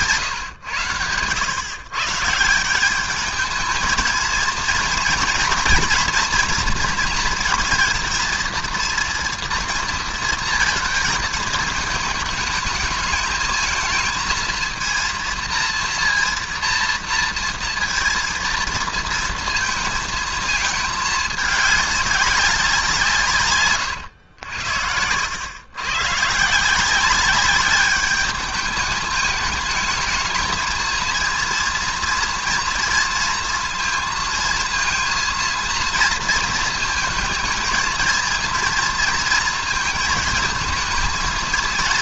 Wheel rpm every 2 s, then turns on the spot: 110, 180, 230, 230, 230, 230, 220, 230, 230, 230, 220, 190, 90, 160, 210, 220, 230, 230, 230, 230, 230.
none